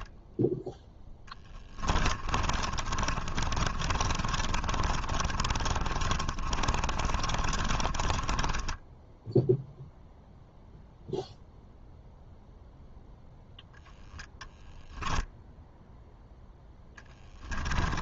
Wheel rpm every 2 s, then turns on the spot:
10, 30, 30, 30, 10, 0, 0, 0, 0.
0-10